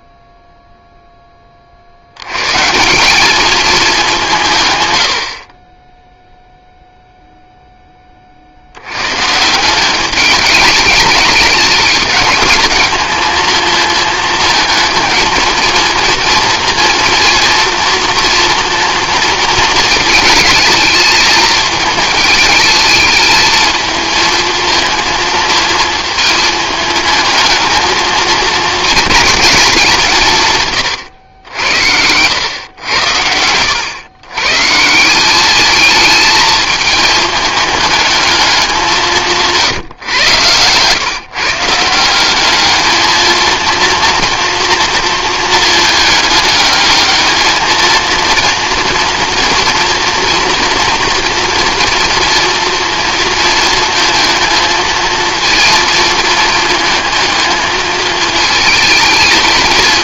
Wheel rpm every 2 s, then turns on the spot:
0, 160, 140, 0, 80, 210, 210, 220, 230, 230, 220, 210, 220, 220, 220, 130, 100, 150, 220, 200, 120, 210, 230, 210, 230, 230, 230, 230, 220, 220.
none